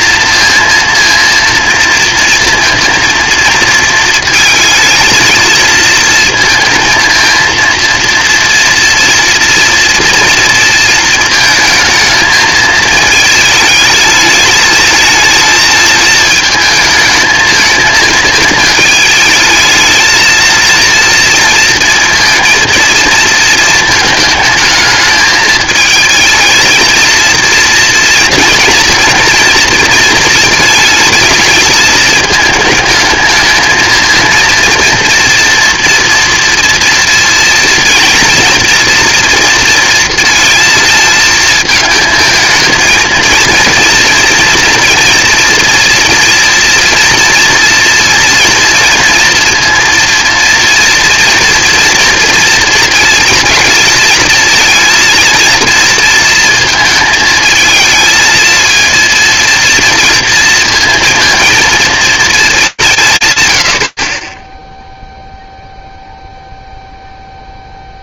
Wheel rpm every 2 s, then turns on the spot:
230, 230, 220, 230, 230, 230, 220, 220, 220, 210, 230, 230, 220, 220, 230, 230, 220, 230, 230, 230, 220, 220, 240, 230, 230, 230, 230, 230, 230, 230, 230, 210, 0, 0.
none